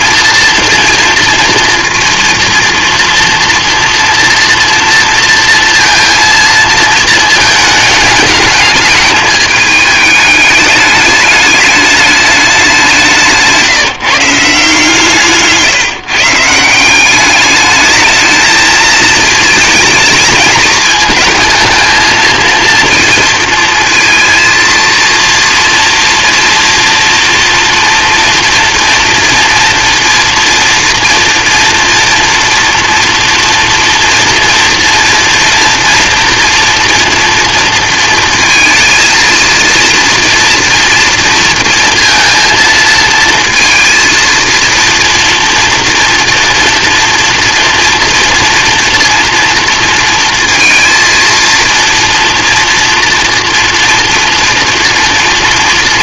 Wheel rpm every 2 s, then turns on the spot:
230, 230, 230, 220, 220, 210, 190, 150, 170, 220, 220, 230, 230, 230, 230, 230, 230, 230, 230, 230, 240, 230, 230, 230, 230, 230, 230, 230.
none